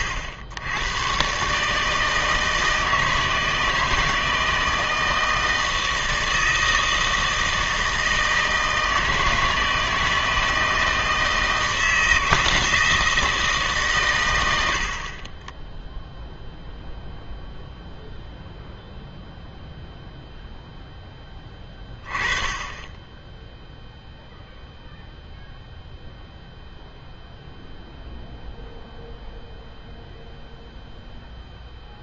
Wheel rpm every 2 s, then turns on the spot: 90, 160, 160, 160, 160, 160, 160, 80, 0, 0, 0, 10, 0, 0, 0, 0.
none